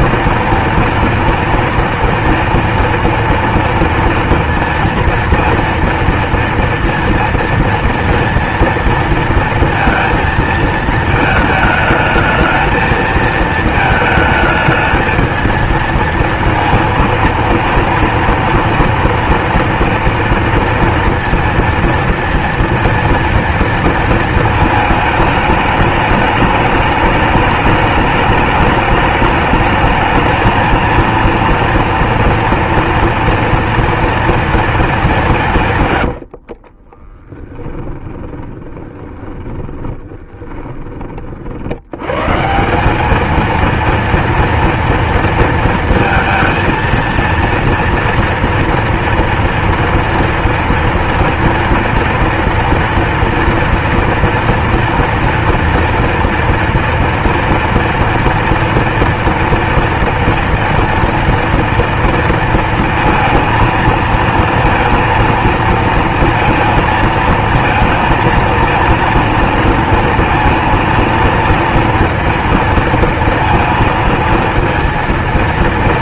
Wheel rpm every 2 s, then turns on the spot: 230, 230, 230, 230, 230, 220, 220, 220, 230, 230, 230, 230, 220, 210, 210, 230, 240, 220, 40, 20, 30, 190, 230, 230, 230, 230, 230, 230, 230, 230, 230, 230, 230, 230, 230, 230, 230, 230.
36-40